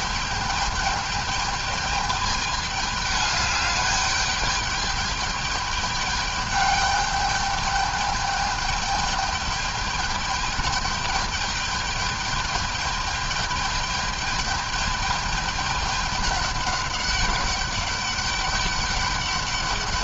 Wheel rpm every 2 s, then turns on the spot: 210, 210, 210, 210, 210, 210, 210, 210, 200, 200.
none